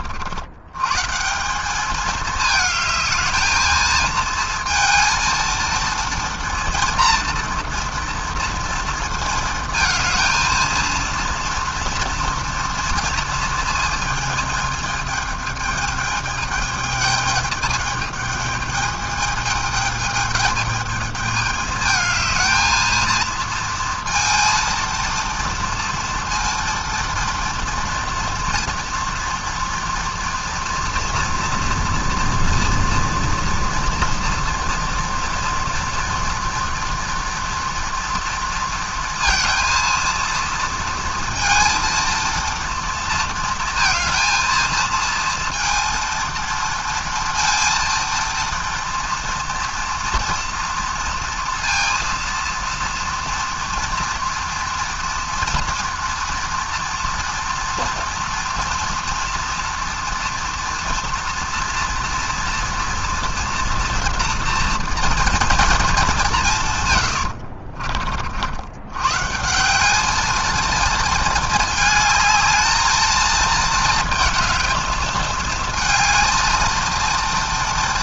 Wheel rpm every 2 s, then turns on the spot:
110, 210, 220, 230, 230, 230, 230, 220, 210, 210, 210, 220, 230, 230, 240, 230, 230, 230, 230, 230, 230, 230, 220, 230, 230, 230, 230, 230, 230, 240, 230, 230, 230, 160, 90, 220, 220, 220, 220.
none